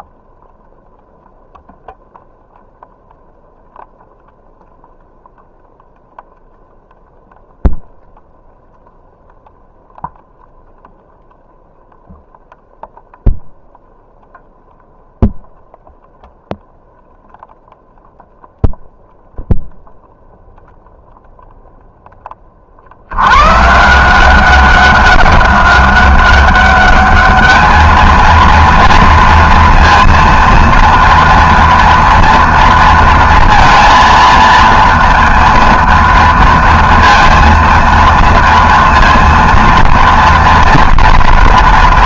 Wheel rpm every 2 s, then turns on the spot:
0, 0, 0, 0, 0, 0, 0, 0, 0, 0, 0, 40, 190, 200, 230, 230, 230, 230, 230, 230, 230.
none